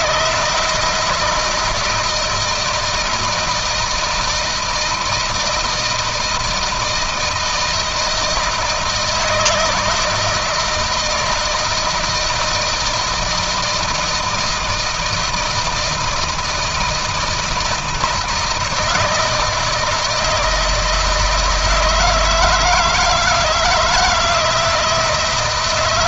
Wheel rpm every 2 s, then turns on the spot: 160, 160, 160, 160, 160, 160, 160, 170, 160, 160, 160, 160, 160.
none